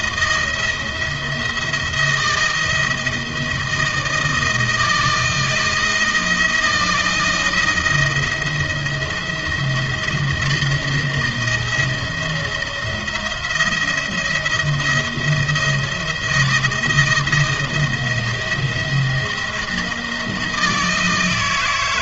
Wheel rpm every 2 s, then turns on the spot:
170, 160, 160, 170, 170, 160, 170, 160, 170, 170, 160.
none